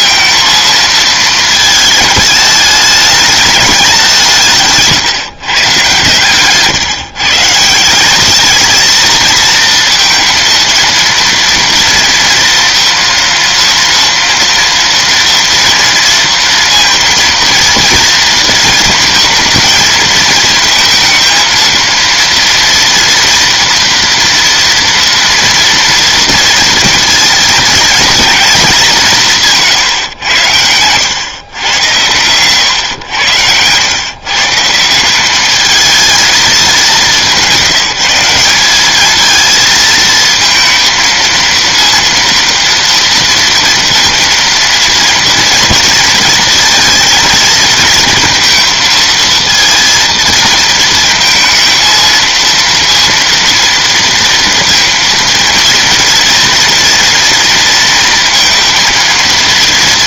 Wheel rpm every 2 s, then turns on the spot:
230, 210, 160, 130, 210, 230, 230, 230, 230, 220, 230, 230, 230, 230, 210, 110, 110, 150, 200, 200, 230, 230, 230, 230, 230, 230, 230, 230, 230, 230.
32-34